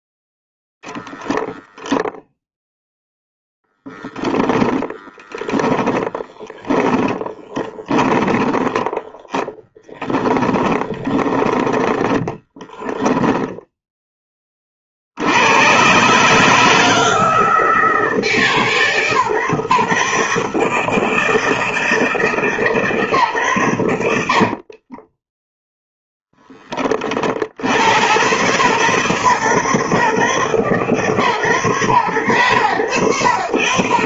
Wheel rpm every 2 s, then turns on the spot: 0, 0, 10, 10, 10, 20, 0, 40, 160, 150, 160, 150, 50, 20, 130, 130, 100.
4-12 24-26